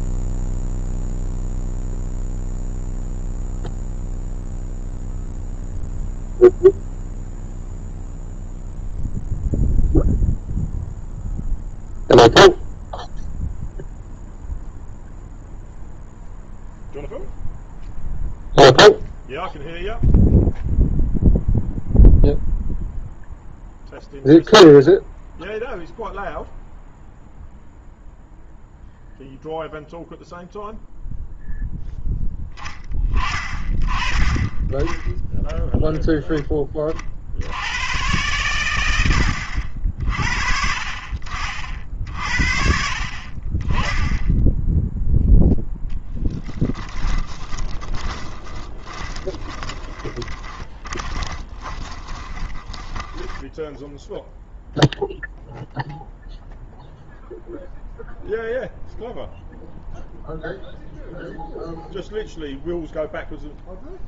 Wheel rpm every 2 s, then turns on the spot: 0, 0, 0, 0, 0, 0, 0, 0, 0, 0, 0, 0, 0, 0, 0, 0, 10, 30, 10, 120, 50, 50, 10, 10, 20, 30, 20, 0, 0, 0, 0, 0.
46-54